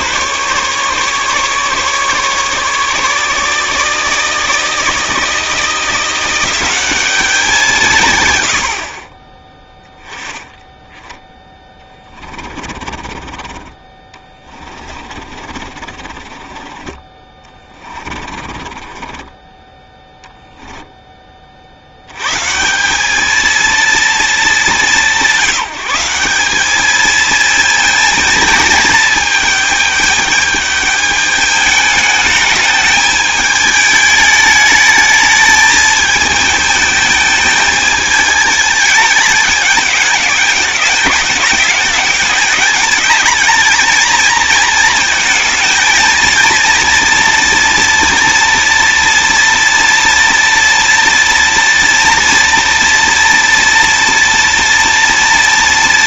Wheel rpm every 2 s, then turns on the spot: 140, 150, 160, 190, 70, 10, 40, 30, 30, 40, 0, 180, 200, 210, 220, 210, 210, 220, 220, 210, 210, 210, 220, 230, 230, 230, 230, 230.
12-16 18-20